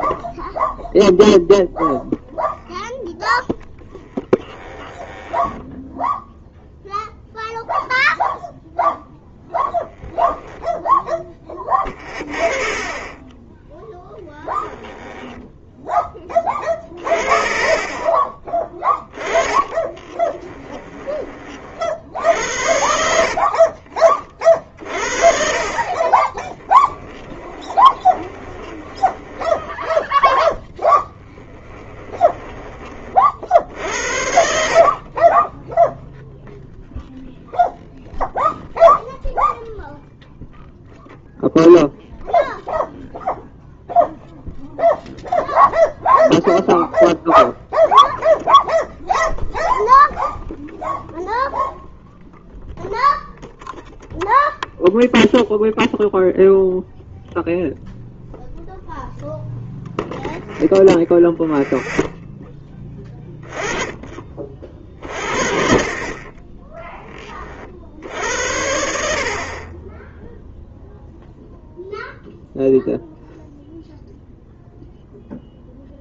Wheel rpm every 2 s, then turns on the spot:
0, 10, 0, 0, 0, 20, 10, 20, 30, 20, 60, 30, 20, 20, 10, 10, 50, 20, 0, 0, 0, 0, 0, 0, 0, 0, 0, 0, 0, 0, 0, 20, 50, 20, 60, 0, 0, 0.
2-4 18-20 22-32 34-36